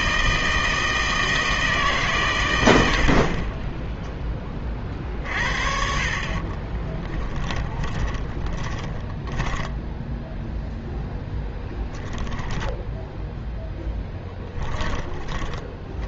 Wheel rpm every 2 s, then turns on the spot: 160, 90, 30, 30, 10, 0, 10, 10.
6-10 12-16